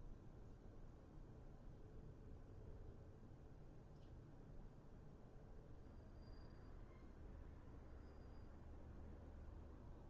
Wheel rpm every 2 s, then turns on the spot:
0, 0, 0, 0, 0.
none